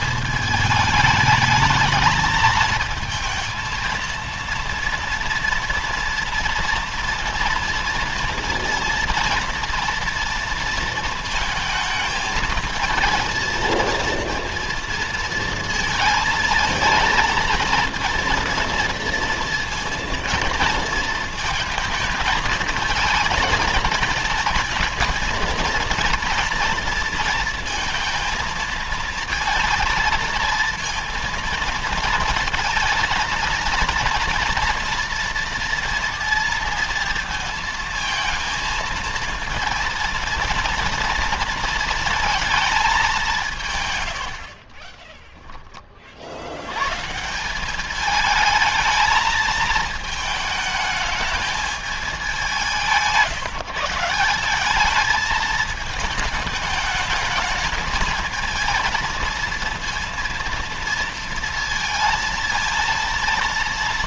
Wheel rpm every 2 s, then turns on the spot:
210, 220, 230, 240, 230, 230, 220, 230, 220, 230, 220, 220, 220, 230, 230, 230, 230, 230, 230, 230, 230, 200, 20, 120, 220, 220, 170, 210, 220, 230, 230, 230.
44-46